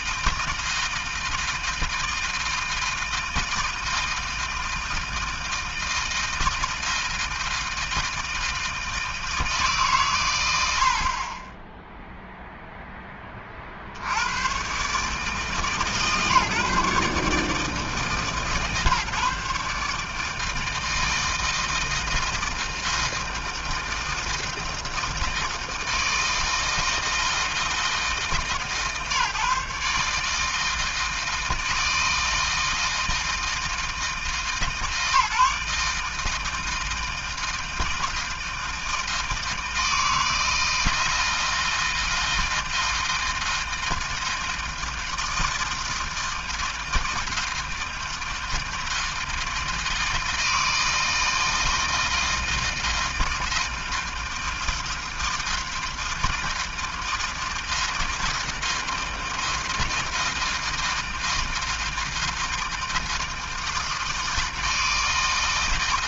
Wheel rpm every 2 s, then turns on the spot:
160, 160, 160, 160, 160, 40, 20, 140, 140, 140, 160, 160, 160, 160, 150, 160, 160, 150, 160, 160, 160, 160, 160, 160, 160, 160, 160, 160, 160, 160, 160, 160, 160.
none